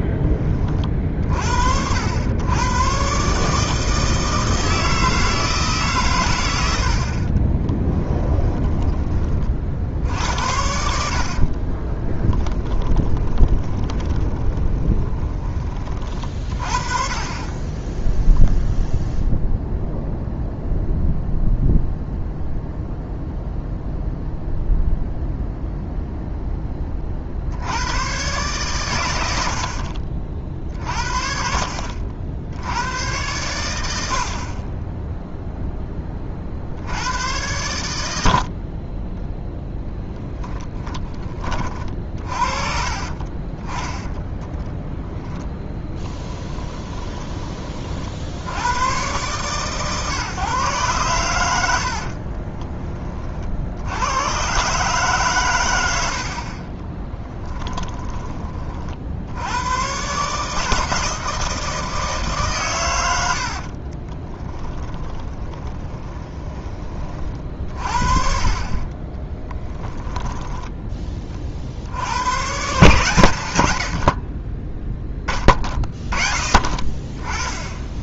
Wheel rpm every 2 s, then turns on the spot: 30, 110, 160, 70, 20, 70, 20, 20, 30, 0, 0, 0, 0, 20, 120, 50, 80, 20, 60, 40, 10, 40, 10, 10, 90, 130, 30, 140, 30, 40, 150, 130, 10, 30, 30, 10, 130, 20, 30.
6-8 12-16 42-48 64-66 70-72